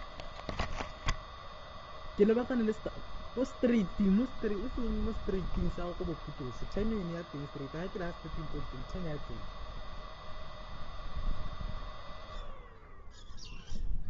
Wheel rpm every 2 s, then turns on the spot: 0, 0, 0, 0, 0, 0, 0.
none